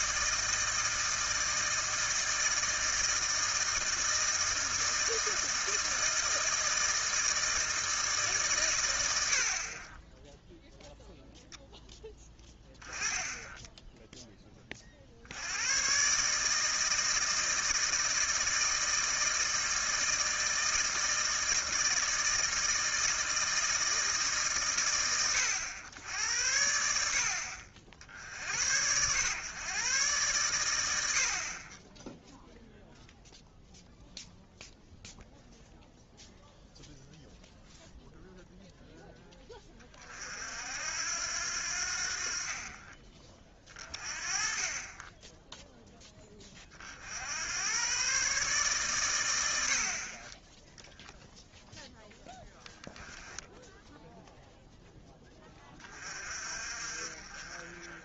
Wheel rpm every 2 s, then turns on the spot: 160, 160, 160, 160, 120, 0, 10, 20, 150, 160, 160, 160, 130, 90, 90, 100, 0, 0, 0, 0, 60, 40, 30, 30, 140, 10, 0, 0, 40.
none